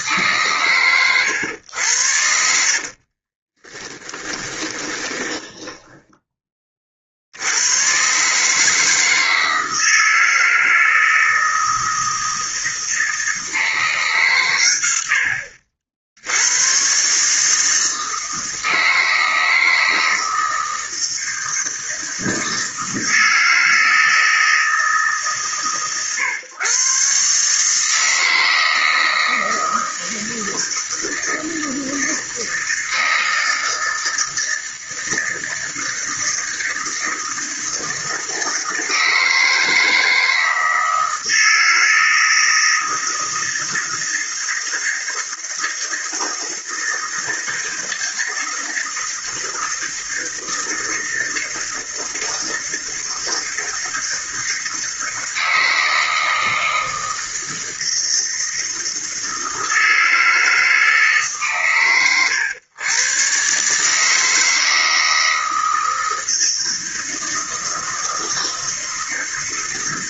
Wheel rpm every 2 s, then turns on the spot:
120, 50, 20, 30, 160, 160, 160, 110, 120, 160, 160, 160, 160, 130, 160, 160, 160, 160, 160, 160, 160, 160, 160, 160, 160, 160, 160, 160, 160, 160, 150, 120, 160, 160, 160.
2-6